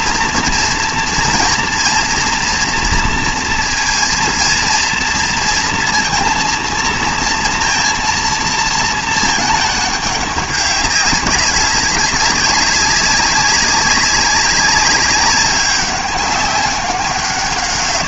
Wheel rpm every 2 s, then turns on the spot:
230, 230, 230, 230, 230, 200, 200, 190, 200.
none